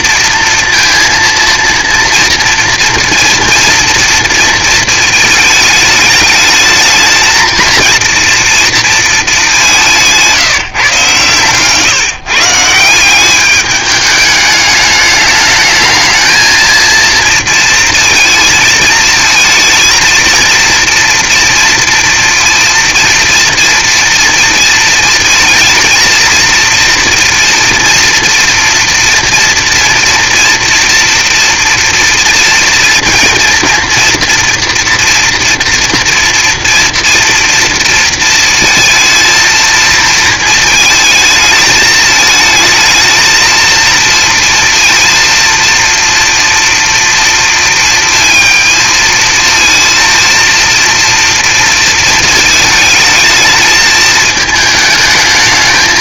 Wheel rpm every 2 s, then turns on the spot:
230, 230, 230, 220, 230, 180, 160, 210, 220, 230, 230, 230, 230, 230, 230, 230, 230, 230, 230, 230, 230, 220, 230, 230, 230, 230, 230, 220.
none